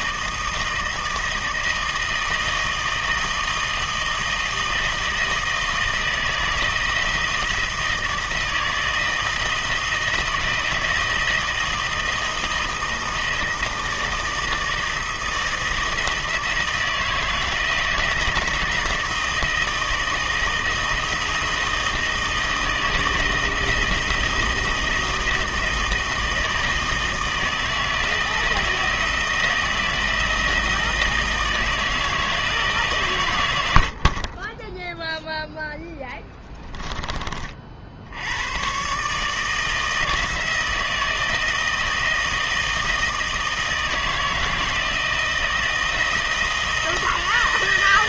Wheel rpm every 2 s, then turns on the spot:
160, 160, 160, 160, 160, 160, 160, 160, 160, 160, 160, 160, 160, 160, 160, 160, 160, 20, 20, 100, 160, 160, 160, 160.
36-38